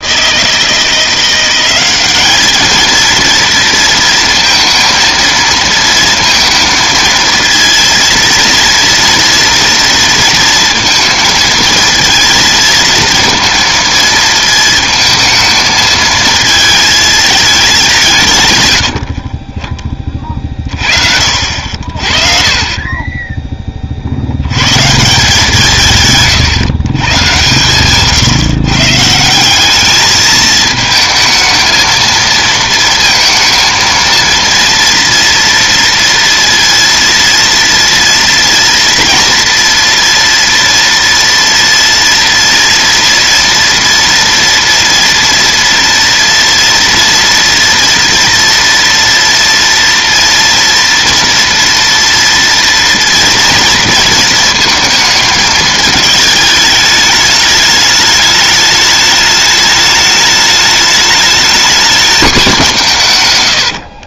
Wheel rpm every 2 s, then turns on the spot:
170, 220, 230, 230, 230, 230, 230, 220, 220, 120, 40, 30, 100, 140, 130, 220, 230, 230, 230, 230, 230, 230, 230, 240, 240, 230, 230, 230, 210, 210, 210, 200.
none